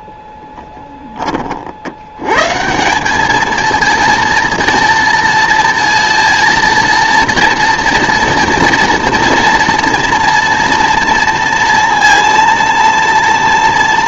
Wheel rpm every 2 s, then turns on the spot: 20, 170, 230, 230, 230, 230, 230.
none